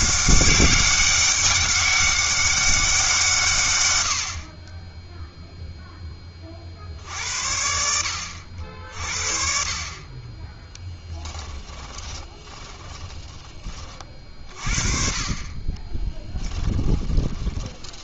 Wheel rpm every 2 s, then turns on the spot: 190, 190, 20, 60, 50, 10, 20, 30, 10.
10-14 16-18